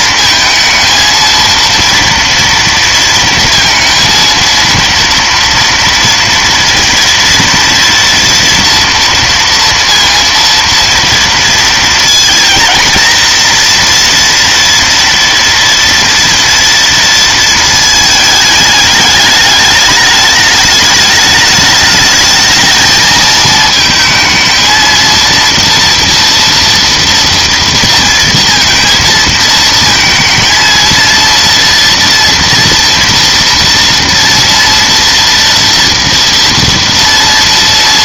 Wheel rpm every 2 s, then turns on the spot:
230, 230, 230, 230, 230, 230, 230, 230, 230, 210, 210, 220, 230, 230, 230, 230, 230, 230, 230.
none